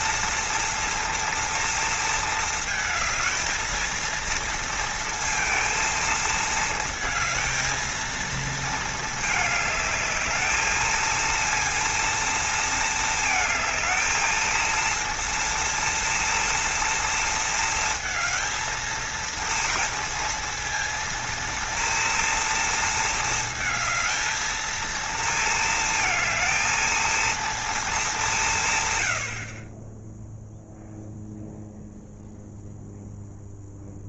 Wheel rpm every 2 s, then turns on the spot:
230, 220, 230, 220, 220, 220, 220, 230, 230, 230, 230, 230, 230, 230, 140, 0, 0.
none